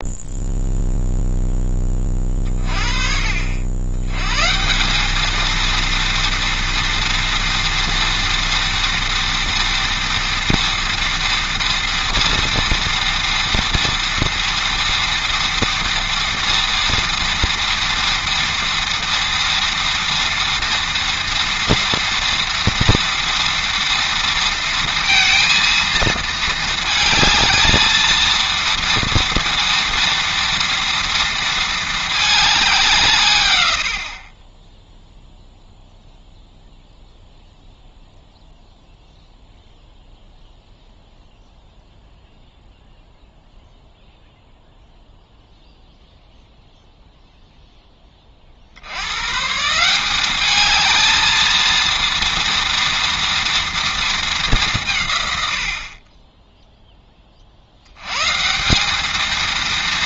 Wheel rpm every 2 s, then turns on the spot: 0, 40, 180, 230, 230, 230, 230, 230, 230, 230, 230, 230, 230, 220, 230, 230, 180, 10, 0, 0, 0, 0, 0, 0, 80, 220, 230, 150, 10, 200.
none